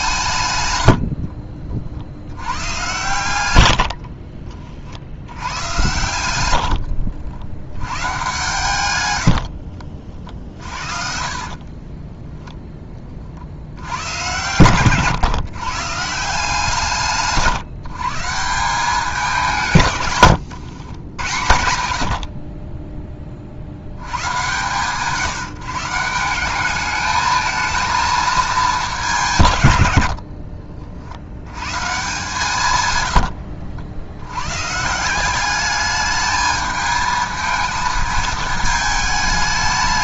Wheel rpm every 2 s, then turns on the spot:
90, 120, 60, 80, 100, 50, 20, 120, 160, 180, 100, 30, 130, 210, 200, 50, 110, 160, 220, 220.
6-8 10-12